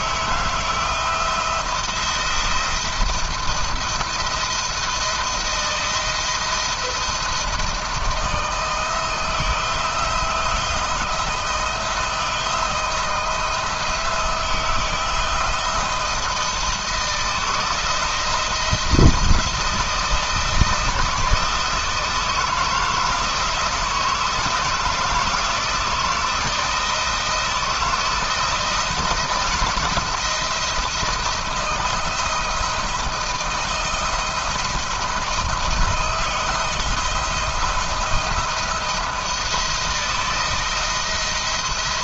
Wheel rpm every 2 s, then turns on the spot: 160, 170, 170, 170, 160, 170, 170, 170, 170, 170, 160, 160, 160, 160, 160, 160, 170, 160, 170, 170, 160.
none